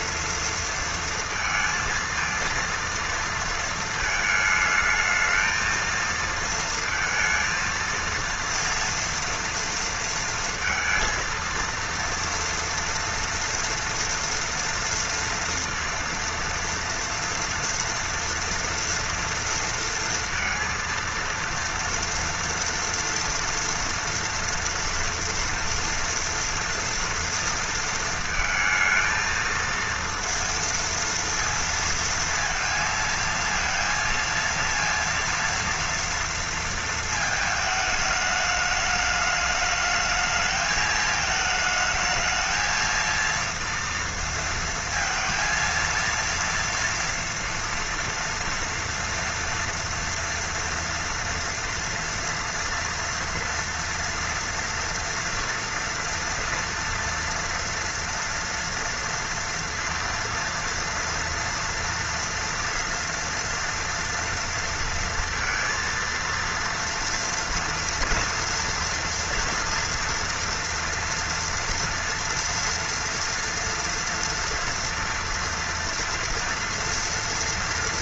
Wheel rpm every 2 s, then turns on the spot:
230, 230, 220, 230, 230, 230, 230, 230, 230, 230, 230, 230, 230, 230, 220, 230, 230, 230, 230, 210, 220, 220, 230, 230, 230, 230, 230, 230, 230, 230, 230, 230, 230, 230, 240, 240, 240, 230, 230.
none